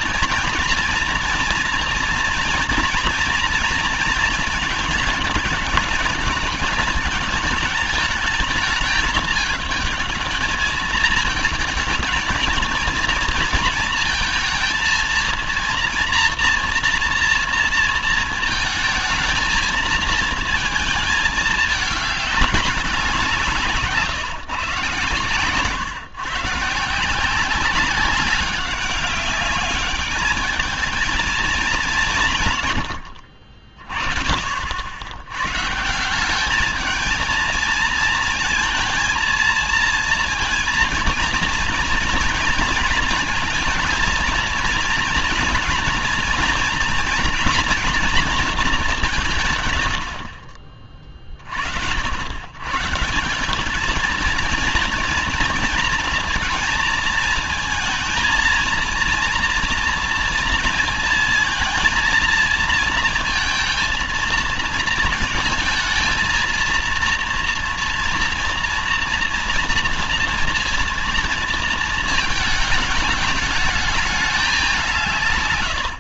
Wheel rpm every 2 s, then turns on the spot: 230, 230, 220, 220, 210, 210, 220, 230, 230, 230, 220, 190, 130, 150, 200, 210, 120, 70, 210, 230, 230, 230, 240, 230, 200, 40, 130, 230, 220, 230, 230, 230, 230, 230, 230, 230, 210, 190.
none